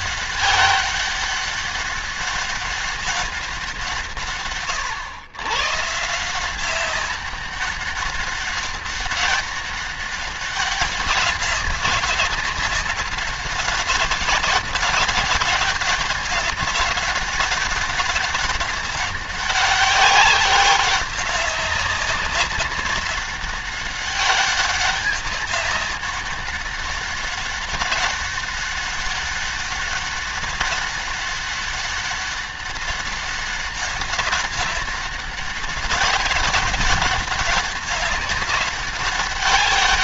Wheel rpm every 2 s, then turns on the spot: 200, 200, 140, 170, 200, 200, 190, 190, 200, 200, 190, 190, 200, 200, 200, 200, 200, 190, 200, 200.
none